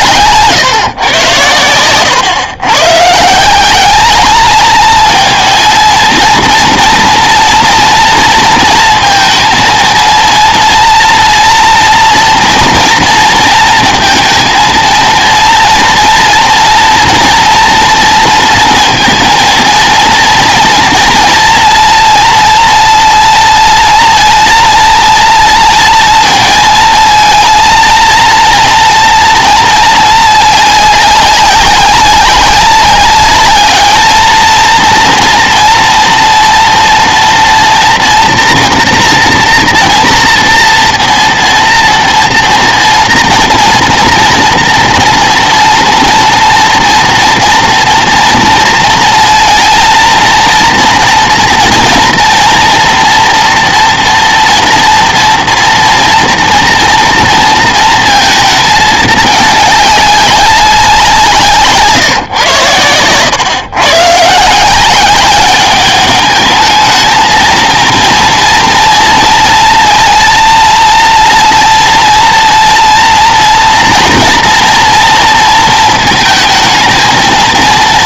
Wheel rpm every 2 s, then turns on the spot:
130, 140, 220, 230, 230, 230, 230, 230, 230, 230, 230, 230, 240, 230, 230, 200, 200, 230, 230, 240, 230, 230, 240, 240, 230, 230, 230, 230, 230, 220, 190, 110, 180, 220, 230, 230, 230, 230, 220.
none